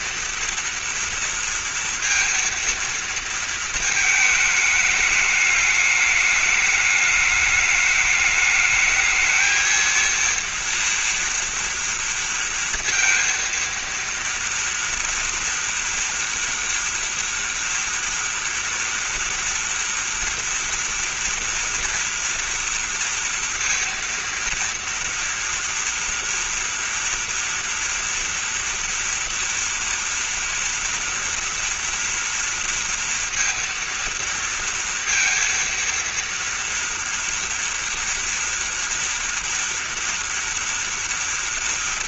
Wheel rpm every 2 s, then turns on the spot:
230, 230, 220, 210, 210, 230, 230, 240, 230, 230, 230, 230, 230, 240, 230, 230, 230, 230, 230, 230, 230.
none